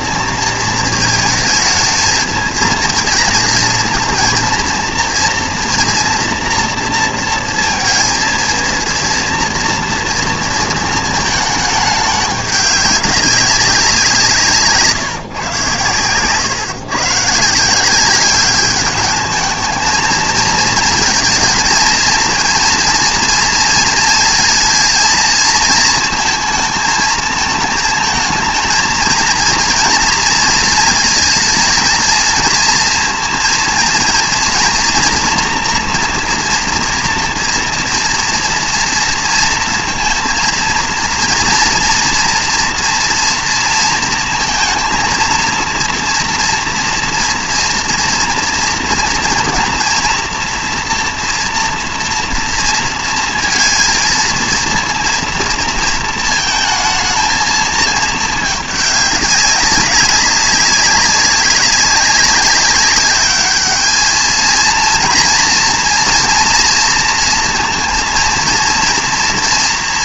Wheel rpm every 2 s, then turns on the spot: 230, 220, 230, 230, 230, 230, 200, 160, 120, 200, 220, 230, 230, 230, 220, 230, 230, 230, 230, 230, 230, 230, 230, 230, 230, 230, 230, 230, 230, 210, 190, 190, 220, 230, 230.
none